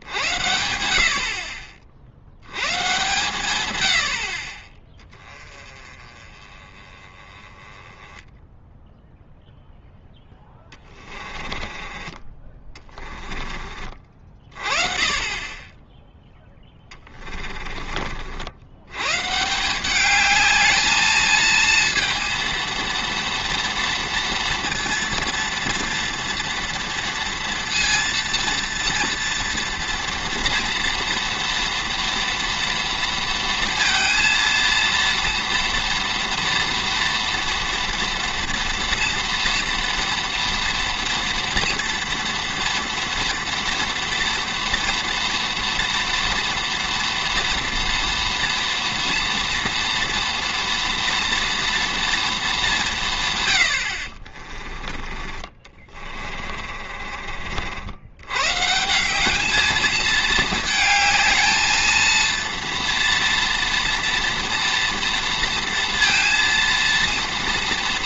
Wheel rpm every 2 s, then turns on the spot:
50, 130, 20, 20, 0, 20, 20, 30, 10, 90, 220, 230, 230, 230, 240, 240, 230, 230, 240, 230, 230, 230, 230, 230, 240, 230, 200, 30, 40, 160, 220, 230, 230, 230.
10-14 16-18 56-58